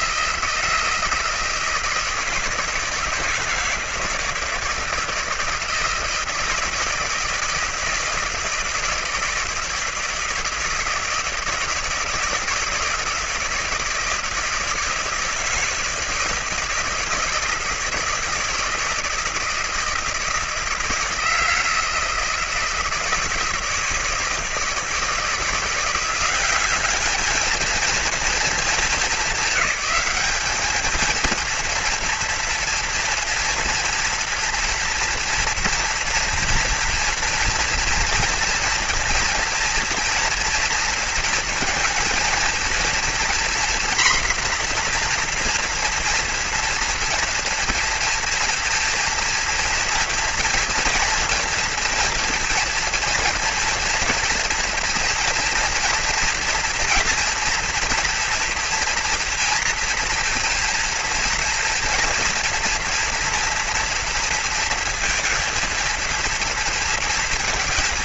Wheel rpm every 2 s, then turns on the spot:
160, 160, 160, 160, 160, 160, 160, 160, 160, 160, 160, 160, 160, 200, 220, 220, 230, 230, 230, 230, 230, 230, 240, 230, 230, 230, 230, 230, 230, 230, 230, 230, 230, 230.
none